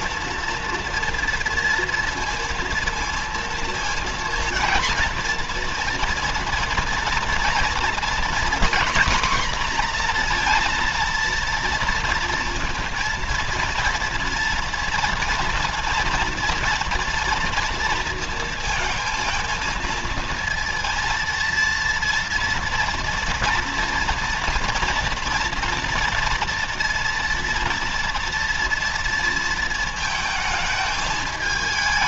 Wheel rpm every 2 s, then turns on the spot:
230, 230, 230, 240, 250, 230, 230, 230, 230, 230, 230, 230, 240, 230, 230, 220.
none